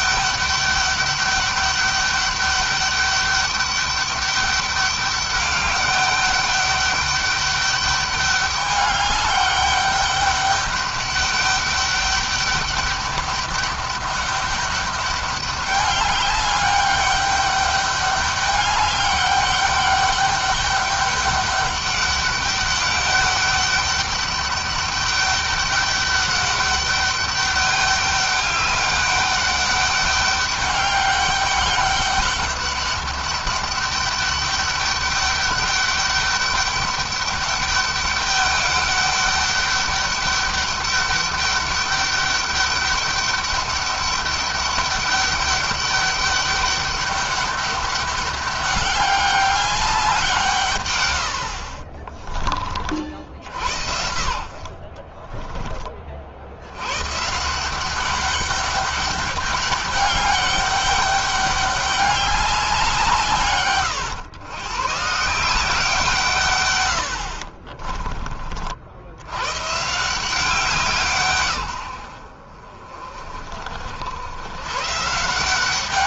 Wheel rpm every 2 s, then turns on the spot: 210, 200, 200, 200, 200, 200, 200, 200, 200, 200, 200, 200, 200, 200, 200, 200, 200, 200, 200, 200, 200, 200, 200, 200, 200, 120, 40, 40, 110, 200, 200, 170, 130, 100, 80, 170, 40, 130.
54-56